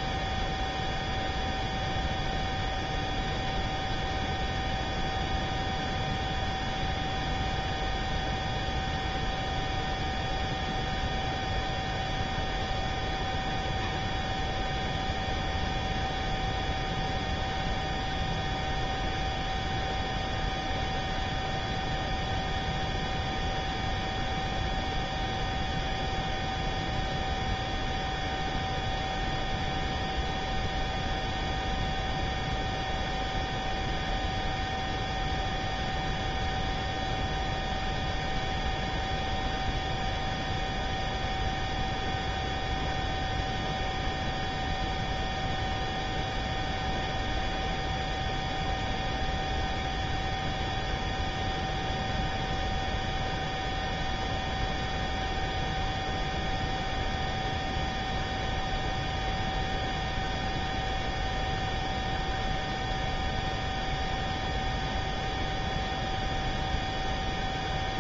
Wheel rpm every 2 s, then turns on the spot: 0, 0, 0, 0, 0, 0, 0, 0, 0, 0, 0, 0, 0, 0, 0, 0, 0, 0, 0, 0, 0, 0, 0, 0, 0, 0, 0, 0, 0, 0, 0, 0, 0, 0.
none